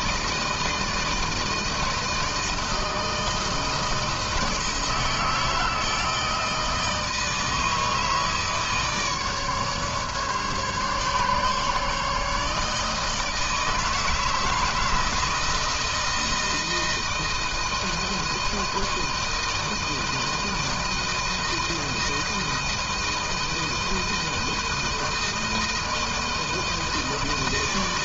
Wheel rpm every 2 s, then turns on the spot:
160, 160, 160, 160, 150, 140, 160, 160, 160, 160, 160, 160, 160, 160.
none